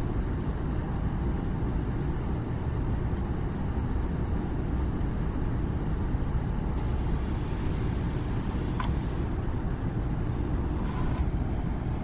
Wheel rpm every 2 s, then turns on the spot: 0, 0, 0, 0, 0, 0.
none